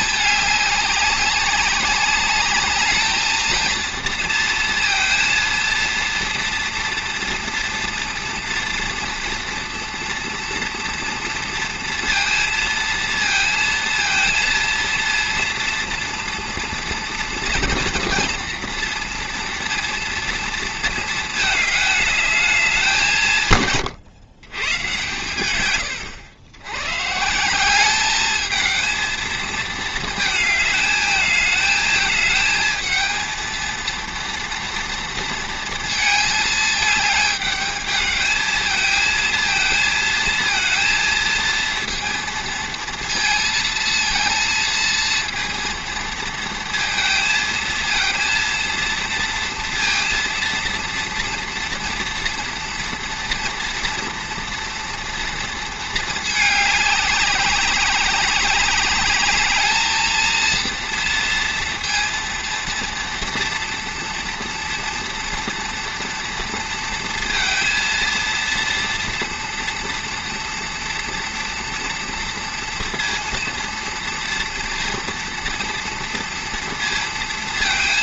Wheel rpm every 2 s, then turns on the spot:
200, 210, 230, 240, 230, 230, 230, 230, 230, 230, 230, 210, 120, 100, 220, 220, 220, 230, 220, 220, 220, 230, 220, 230, 230, 230, 230, 240, 210, 200, 230, 230, 230, 230, 230, 230, 230, 240, 230.
none